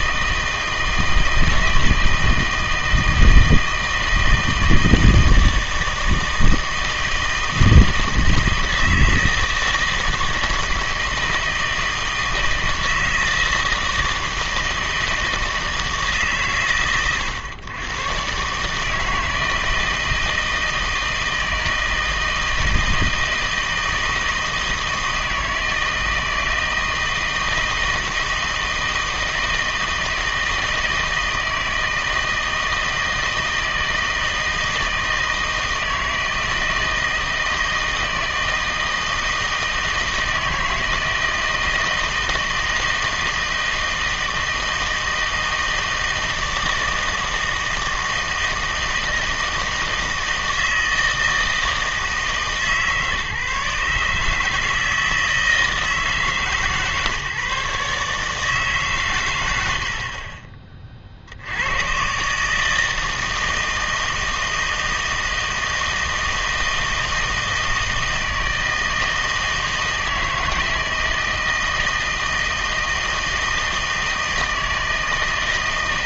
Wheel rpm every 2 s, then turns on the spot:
160, 160, 160, 160, 160, 160, 160, 160, 130, 150, 160, 160, 160, 160, 160, 160, 160, 160, 160, 160, 160, 160, 160, 160, 160, 160, 150, 160, 140, 140, 40, 150, 160, 160, 160, 160, 160, 160.
none